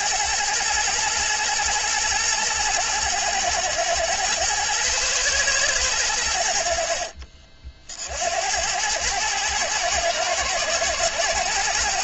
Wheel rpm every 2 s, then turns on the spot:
110, 110, 120, 60, 100, 110.
none